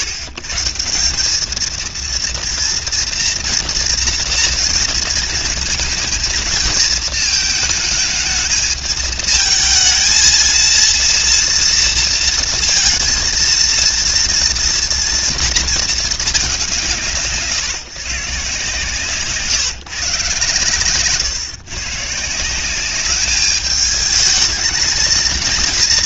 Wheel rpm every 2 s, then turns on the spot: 130, 230, 230, 230, 220, 230, 230, 230, 190, 140, 120, 180, 220.
none